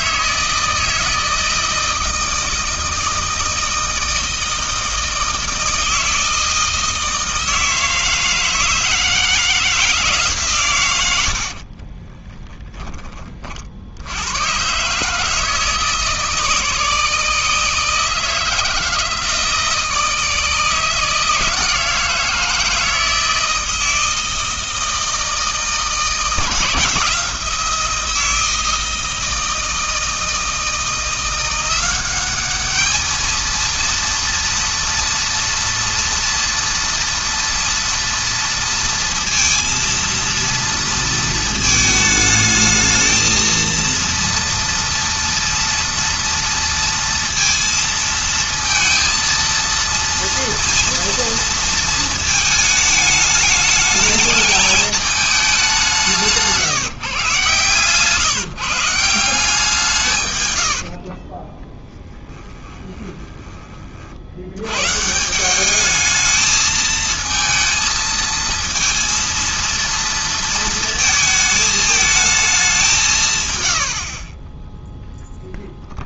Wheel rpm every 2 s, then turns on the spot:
160, 160, 160, 160, 160, 130, 10, 120, 160, 160, 160, 160, 160, 160, 160, 170, 210, 230, 230, 230, 230, 220, 240, 230, 230, 230, 220, 220, 150, 150, 90, 20, 110, 220, 230, 230, 200, 10.
60-64